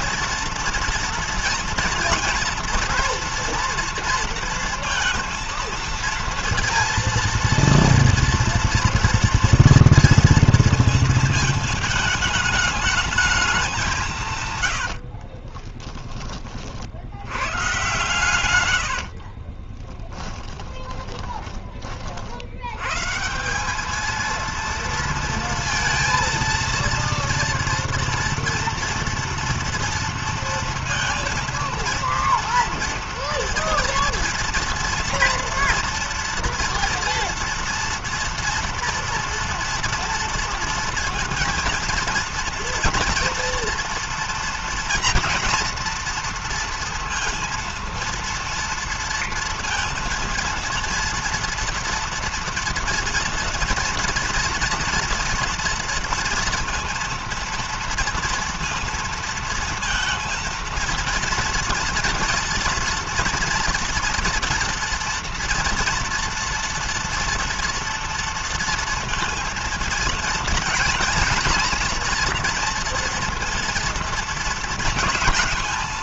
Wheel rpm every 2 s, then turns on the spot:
230, 230, 230, 230, 230, 230, 220, 130, 40, 120, 10, 60, 230, 230, 230, 230, 230, 230, 230, 230, 230, 230, 230, 230, 230, 230, 230, 230, 230, 230, 230, 230, 230, 230, 230, 230, 230, 230.
14-16 18-22